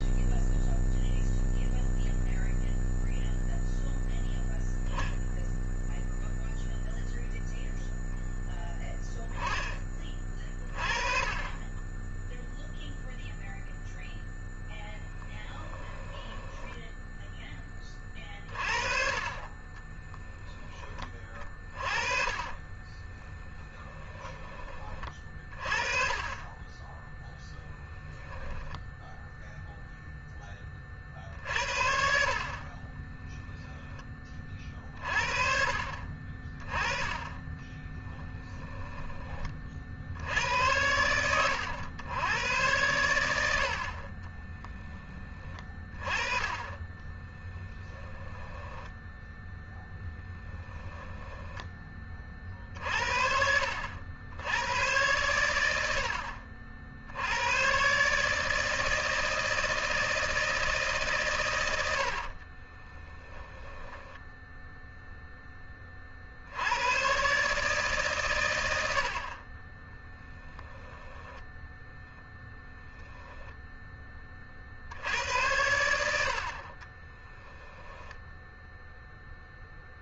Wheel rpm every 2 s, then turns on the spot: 0, 0, 0, 0, 10, 30, 0, 10, 10, 30, 10, 20, 20, 20, 0, 20, 40, 30, 20, 10, 90, 100, 20, 20, 20, 10, 40, 110, 60, 150, 160, 30, 0, 70, 110, 0, 10, 40, 40, 0.
16-18 22-24 32-34 44-50 62-64 72-74 76-78